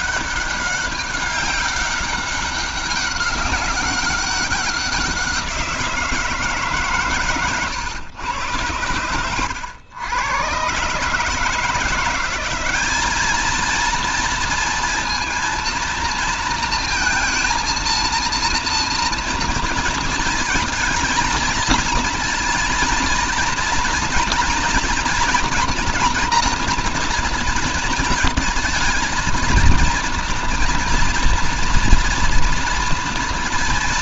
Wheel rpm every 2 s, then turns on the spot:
200, 200, 200, 160, 120, 120, 180, 230, 230, 230, 220, 230, 230, 240, 220, 230, 230.
none